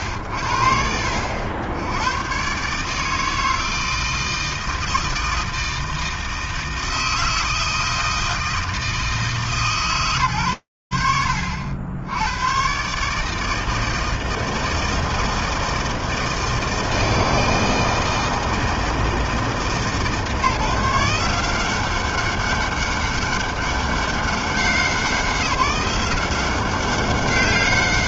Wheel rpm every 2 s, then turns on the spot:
60, 140, 160, 160, 160, 100, 130, 160, 160, 160, 150, 200, 180, 190.
none